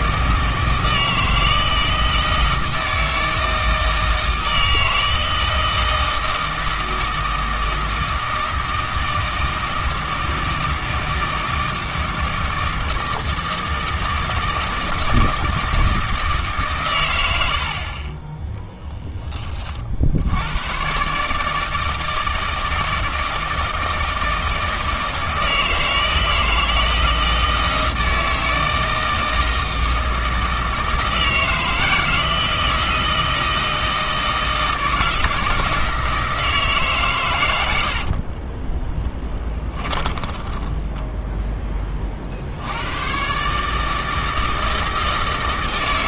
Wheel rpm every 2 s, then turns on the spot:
160, 160, 160, 160, 160, 160, 160, 160, 130, 10, 120, 160, 160, 160, 160, 160, 160, 160, 150, 20, 10, 90, 160.
38-42